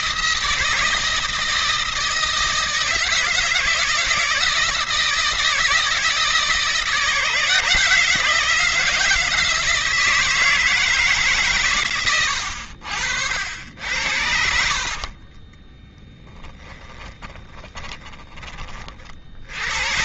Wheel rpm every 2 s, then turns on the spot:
160, 160, 160, 170, 170, 160, 80, 50, 10, 40.
14-18